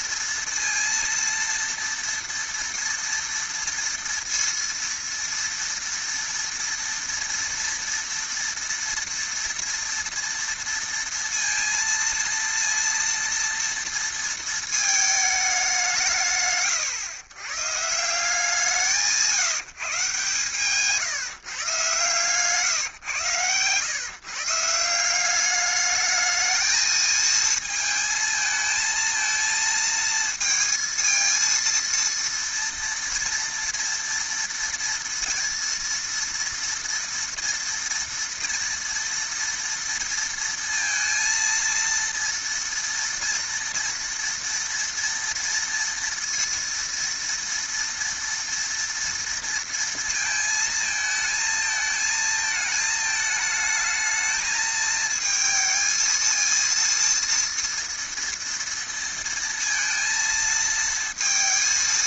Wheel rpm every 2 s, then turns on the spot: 230, 230, 230, 230, 230, 230, 230, 220, 120, 170, 140, 140, 150, 220, 220, 230, 240, 230, 230, 230, 230, 230, 230, 230, 230, 220, 220, 220, 230, 230, 230.
none